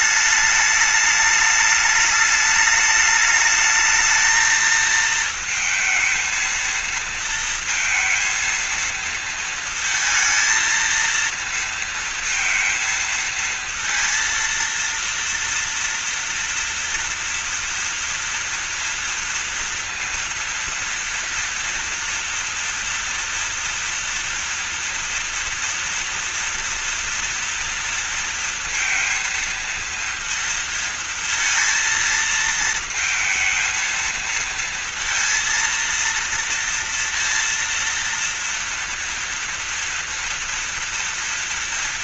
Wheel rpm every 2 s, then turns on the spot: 210, 210, 220, 230, 230, 230, 230, 230, 240, 230, 230, 230, 230, 230, 230, 230, 230, 230, 230, 240, 230.
none